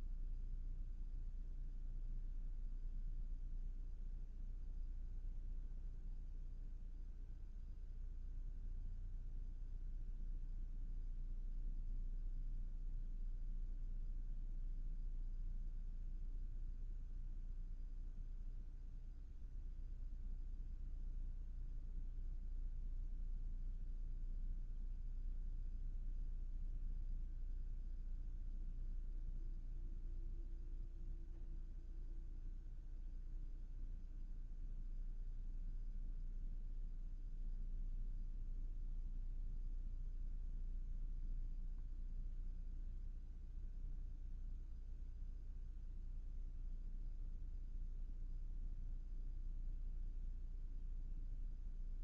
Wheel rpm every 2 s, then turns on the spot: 0, 0, 0, 0, 0, 0, 0, 0, 0, 0, 0, 0, 0, 0, 0, 0, 0, 0, 0, 0, 0, 0, 0, 0, 0, 0.
none